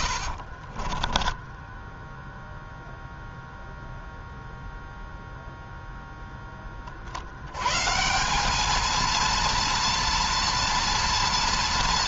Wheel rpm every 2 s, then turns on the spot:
20, 0, 0, 40, 220, 230.
0-2